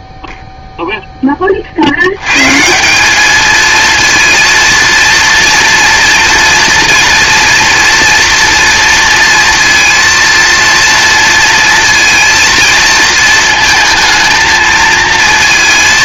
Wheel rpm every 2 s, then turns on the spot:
10, 210, 230, 230, 230, 230, 220, 230.
none